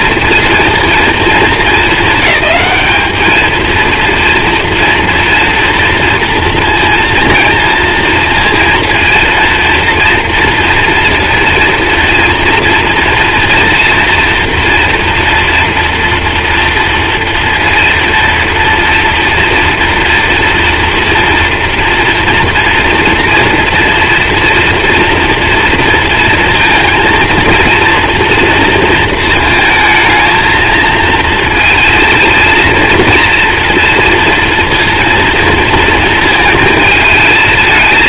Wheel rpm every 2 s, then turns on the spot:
230, 210, 230, 230, 230, 230, 240, 230, 230, 230, 230, 230, 230, 230, 230, 220, 230, 230, 220.
none